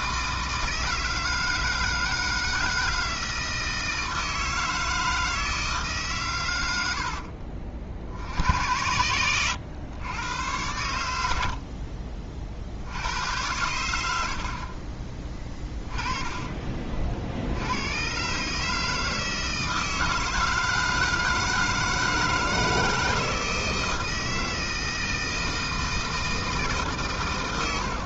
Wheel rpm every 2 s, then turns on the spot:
160, 160, 160, 90, 90, 110, 60, 40, 30, 150, 160, 160, 160, 160.
none